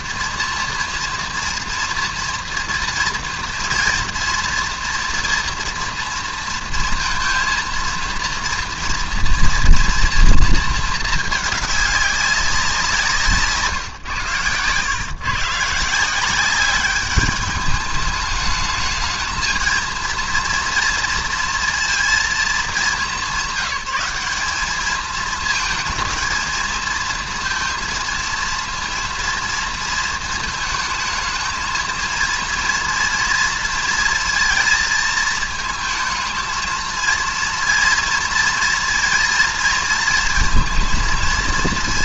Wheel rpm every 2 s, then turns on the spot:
230, 230, 230, 230, 230, 220, 180, 120, 200, 210, 230, 210, 210, 230, 230, 220, 230, 220, 230, 230, 230.
none